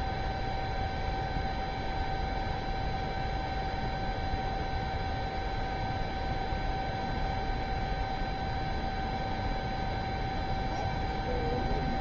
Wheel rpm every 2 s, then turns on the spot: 0, 0, 0, 0, 0, 0.
none